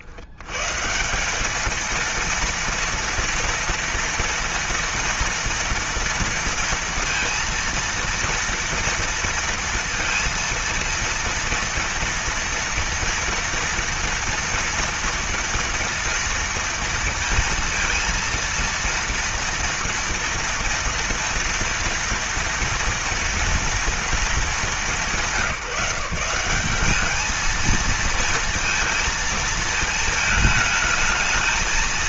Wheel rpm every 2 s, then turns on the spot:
150, 230, 230, 230, 230, 230, 230, 240, 230, 230, 230, 230, 200, 190, 230, 220.
none